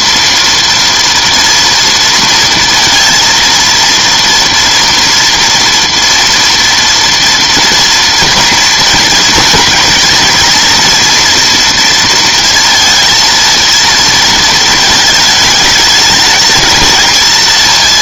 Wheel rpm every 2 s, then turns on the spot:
230, 230, 230, 230, 230, 230, 230, 220, 220.
none